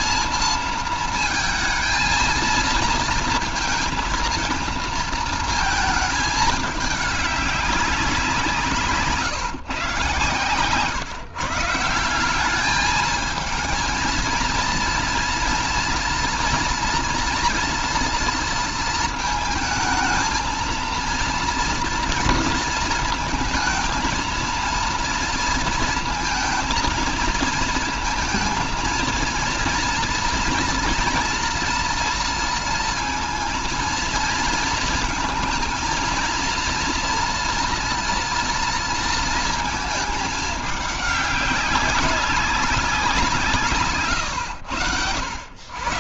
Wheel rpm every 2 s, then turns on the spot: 220, 230, 230, 210, 160, 130, 210, 230, 240, 230, 230, 230, 230, 220, 230, 240, 230, 220, 240, 230, 200, 180, 90.
none